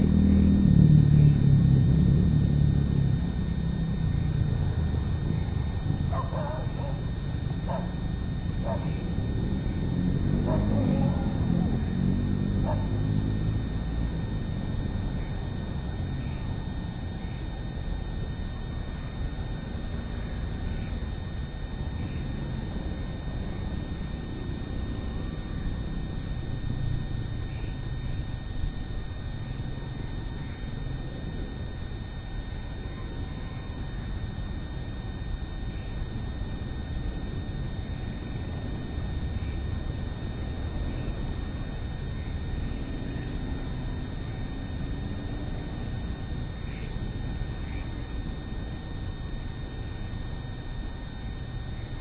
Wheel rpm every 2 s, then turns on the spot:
0, 0, 0, 0, 0, 0, 0, 0, 0, 0, 0, 0, 0, 0, 0, 0, 0, 0, 0, 0, 0, 0, 0, 0, 0, 0.
none